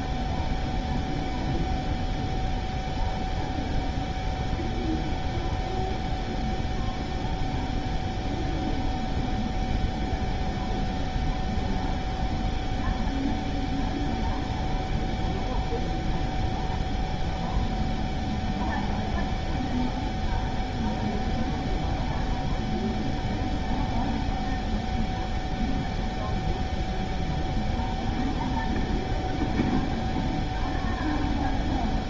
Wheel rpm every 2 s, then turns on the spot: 0, 0, 0, 0, 0, 0, 0, 0, 0, 0, 0, 0, 0, 0, 0, 0.
none